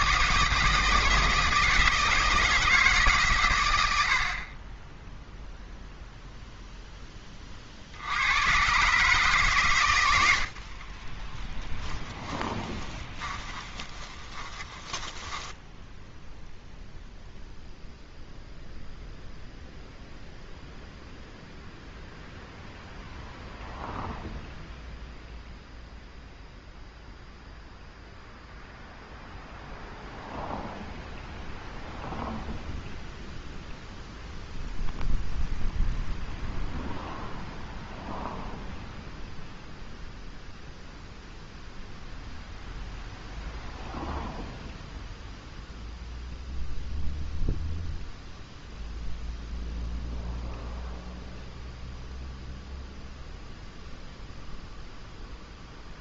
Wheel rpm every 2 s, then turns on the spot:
160, 160, 20, 0, 130, 40, 20, 20, 0, 0, 0, 0, 0, 0, 0, 0, 0, 0, 0, 0, 0, 0, 0, 0, 0, 0, 0, 0.
10-16